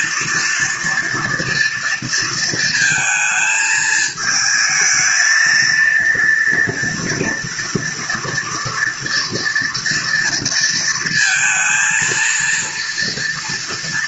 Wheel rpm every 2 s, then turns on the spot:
230, 230, 220, 230, 230, 230, 230.
none